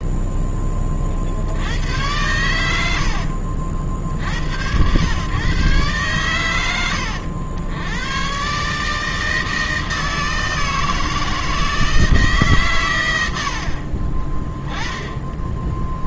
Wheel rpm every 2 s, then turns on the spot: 20, 70, 90, 100, 140, 160, 120, 10.
none